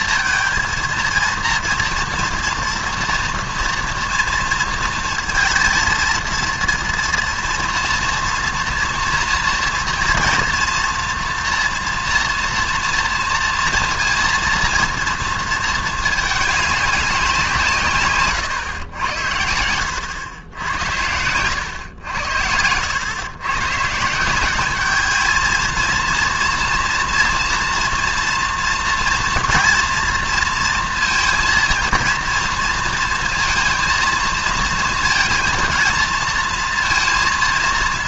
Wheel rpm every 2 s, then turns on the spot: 230, 230, 230, 230, 230, 240, 230, 230, 200, 100, 90, 90, 210, 230, 230, 230, 230, 230, 230.
none